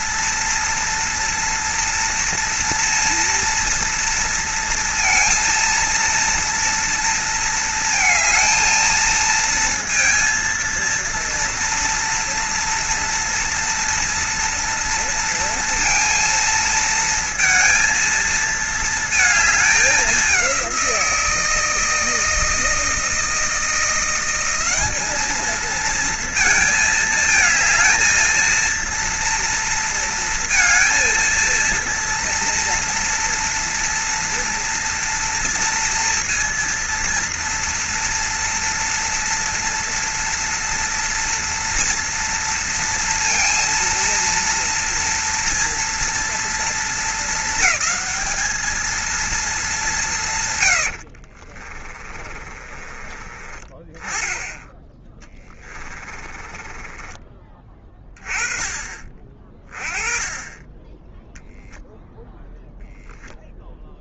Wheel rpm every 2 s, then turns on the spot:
230, 230, 230, 230, 220, 230, 240, 230, 230, 230, 180, 160, 190, 220, 230, 230, 230, 240, 230, 230, 230, 230, 240, 230, 220, 110, 30, 10, 20, 30, 20, 0.
50-54 56-58